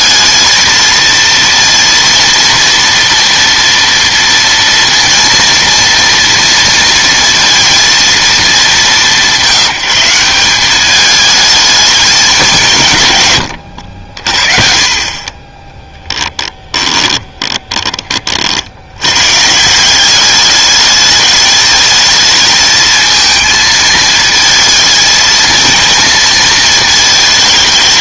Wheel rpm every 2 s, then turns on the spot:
220, 230, 230, 230, 210, 190, 170, 40, 20, 80, 210, 220, 220, 230.
16-18